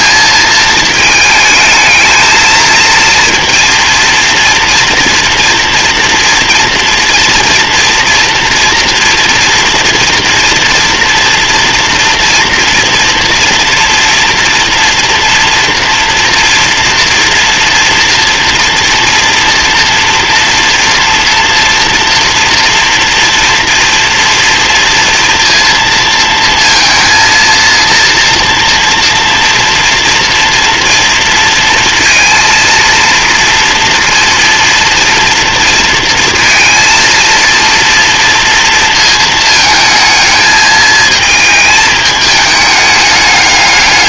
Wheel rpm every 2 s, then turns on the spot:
220, 230, 230, 230, 240, 240, 240, 230, 230, 240, 230, 230, 230, 230, 230, 230, 230, 230, 230, 230, 220, 210.
none